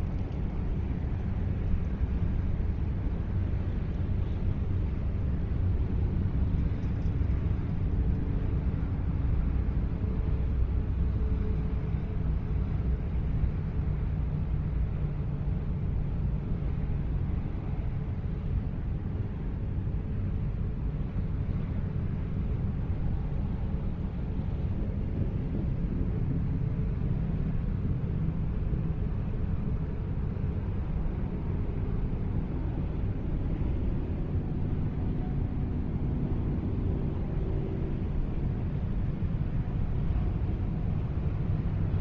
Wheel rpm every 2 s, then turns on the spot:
0, 0, 0, 0, 0, 0, 0, 0, 0, 0, 0, 0, 0, 0, 0, 0, 0, 0, 0, 0, 0.
none